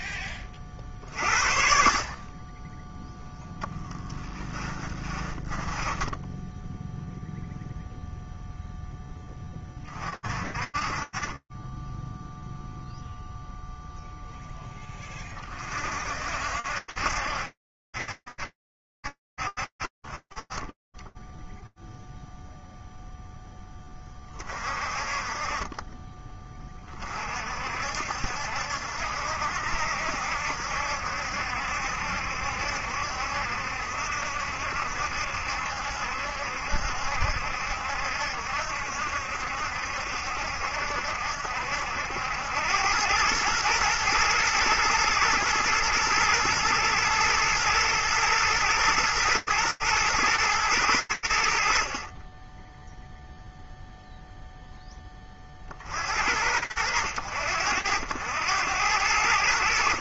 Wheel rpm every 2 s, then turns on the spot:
20, 20, 20, 10, 0, 40, 0, 10, 60, 70, 40, 0, 30, 30, 60, 70, 70, 70, 70, 70, 70, 100, 110, 110, 110, 90, 0, 40, 70, 70.
4-8